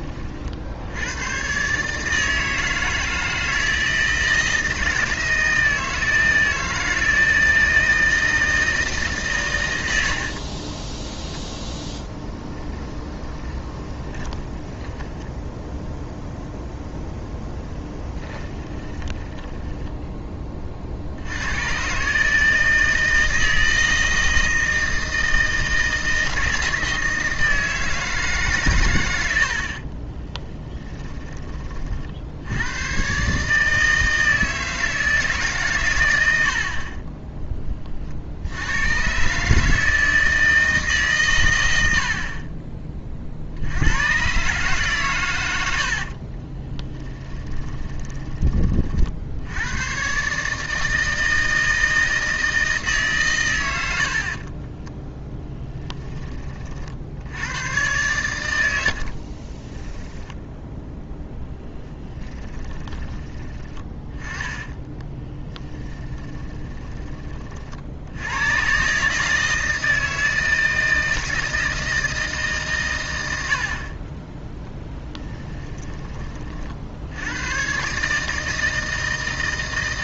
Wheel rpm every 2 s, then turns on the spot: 70, 160, 160, 160, 160, 30, 10, 20, 0, 20, 40, 160, 160, 160, 120, 10, 100, 160, 50, 100, 150, 30, 140, 20, 40, 160, 160, 20, 40, 80, 0, 20, 20, 10, 130, 160, 130, 10, 60, 160.
10-16 18-20 30-32 46-48 54-56 58-60 62-66 74-76